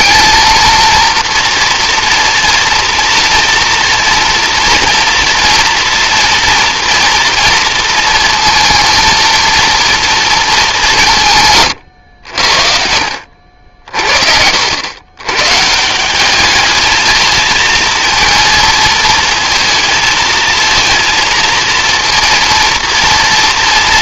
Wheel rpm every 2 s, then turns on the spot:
230, 230, 230, 230, 220, 220, 80, 60, 200, 230, 220, 230.
none